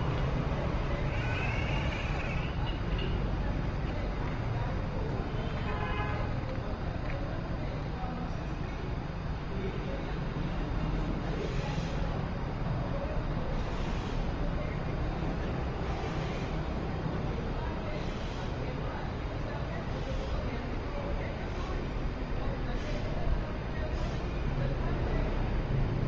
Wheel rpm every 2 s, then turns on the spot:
0, 0, 0, 0, 0, 0, 0, 0, 0, 0, 0, 0, 0.
none